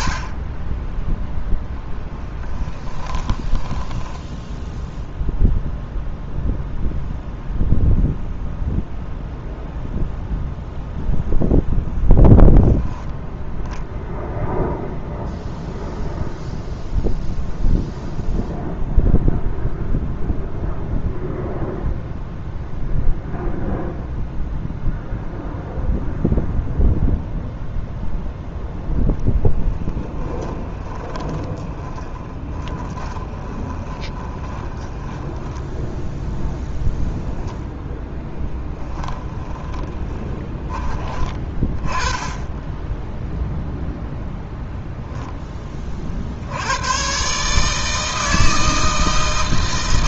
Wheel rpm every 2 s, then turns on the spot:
10, 20, 0, 0, 0, 0, 0, 0, 0, 0, 0, 0, 0, 0, 10, 20, 20, 20, 10, 10, 20, 10, 0, 110, 160.
2-4 30-36 38-40